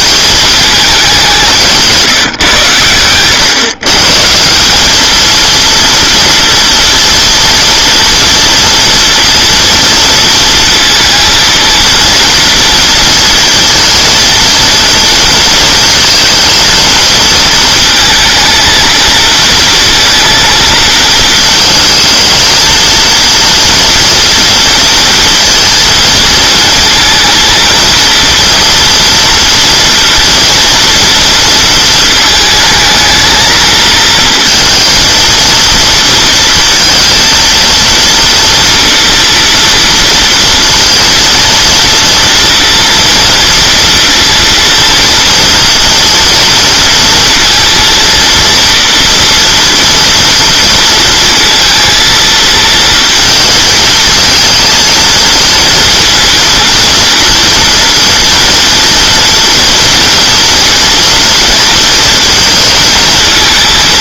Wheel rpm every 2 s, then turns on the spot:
210, 120, 190, 230, 240, 230, 230, 230, 230, 230, 230, 230, 230, 230, 240, 240, 220, 230, 230, 240, 230, 230, 230, 230, 230, 230, 230, 230, 230, 230, 230, 220.
none